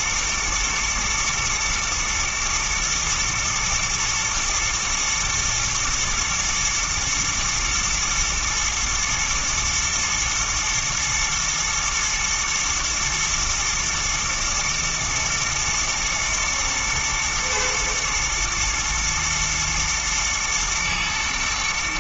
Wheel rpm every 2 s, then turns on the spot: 120, 110, 110, 110, 120, 110, 110, 110, 120, 110, 110.
none